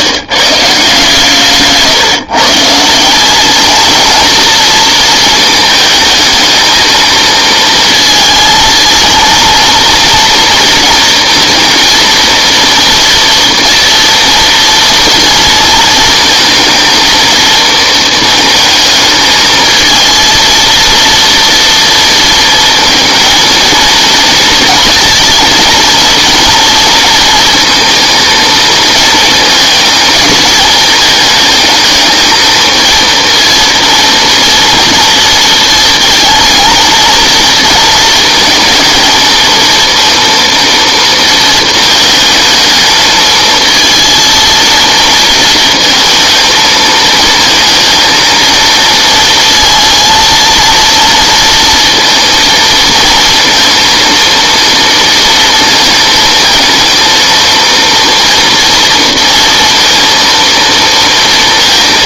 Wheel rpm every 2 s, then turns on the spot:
150, 160, 240, 220, 230, 230, 230, 230, 230, 220, 230, 230, 230, 230, 230, 220, 220, 230, 220, 230, 230, 220, 230, 220, 230, 230, 230, 230, 220, 230, 230.
none